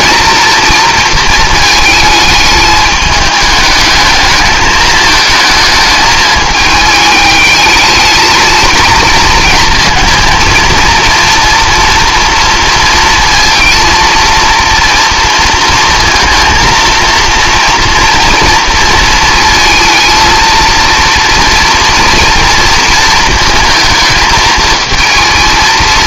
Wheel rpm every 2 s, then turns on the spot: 230, 210, 220, 210, 230, 230, 230, 230, 230, 230, 220, 230, 220.
none